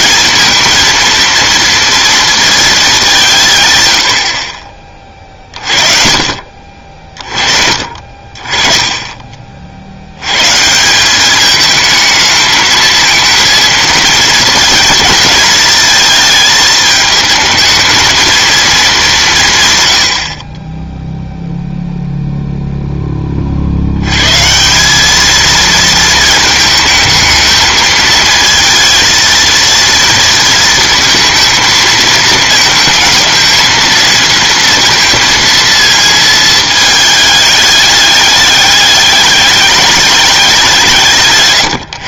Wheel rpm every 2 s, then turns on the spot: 230, 220, 40, 50, 30, 160, 220, 230, 220, 220, 20, 0, 170, 220, 230, 230, 220, 230, 220, 210, 190.
8-10